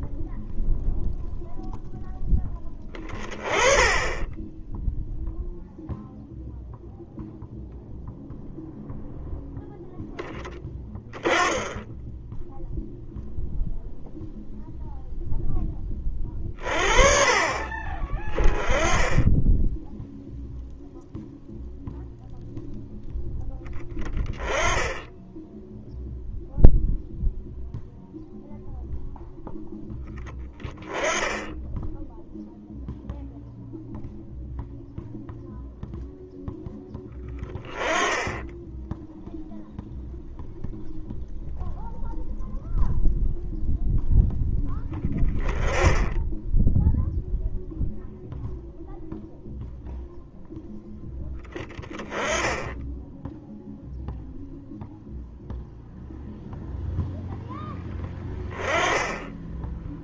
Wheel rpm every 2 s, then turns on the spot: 0, 20, 0, 0, 0, 20, 0, 0, 40, 10, 0, 0, 10, 0, 0, 10, 0, 0, 10, 0, 0, 0, 10, 0, 0, 10, 10, 0, 0, 10.
none